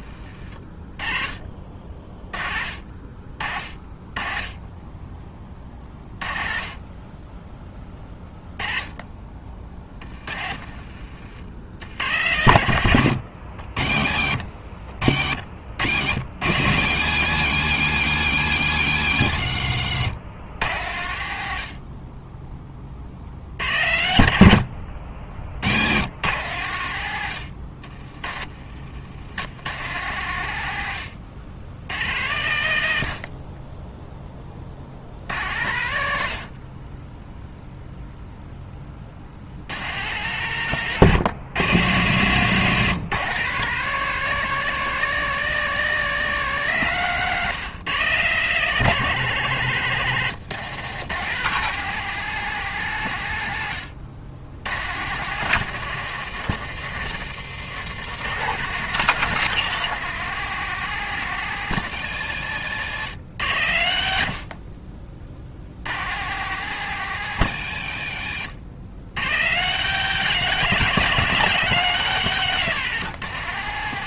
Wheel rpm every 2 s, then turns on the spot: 40, 30, 20, 20, 20, 50, 90, 40, 100, 100, 90, 40, 60, 100, 70, 90, 80, 60, 30, 40, 130, 140, 180, 150, 150, 150, 140, 110, 140, 170, 170, 120, 40, 150, 100, 170, 170.
10-12 62-66